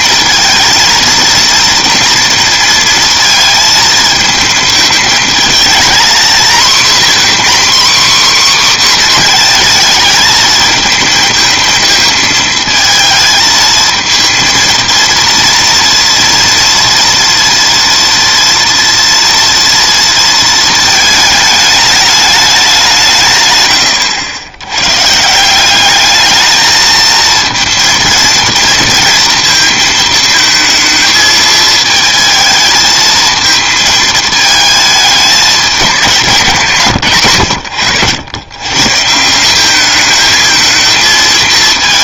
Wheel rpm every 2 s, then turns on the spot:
230, 230, 220, 240, 260, 220, 220, 230, 230, 230, 220, 190, 100, 220, 230, 220, 220, 220, 170, 120, 220.
36-38